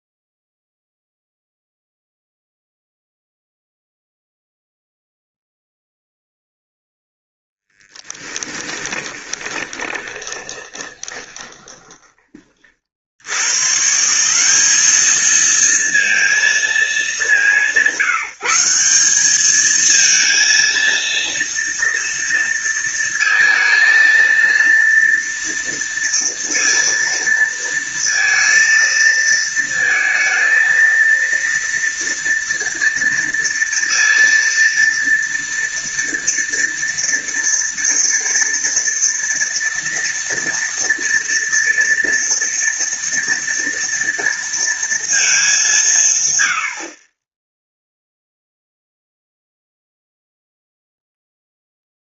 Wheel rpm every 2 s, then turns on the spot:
0, 0, 0, 0, 10, 20, 50, 210, 220, 190, 230, 230, 230, 230, 230, 230, 230, 230, 230, 240, 240, 230, 230, 50, 0, 0.
8-12